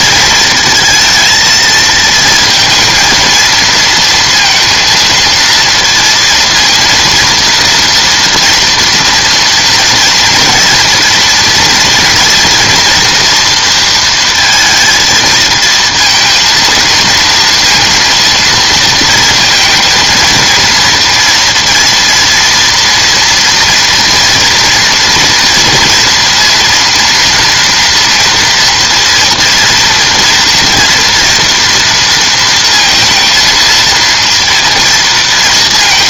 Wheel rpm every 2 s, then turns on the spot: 230, 230, 230, 230, 230, 230, 230, 230, 230, 230, 230, 230, 240, 240, 230, 230, 230, 230.
none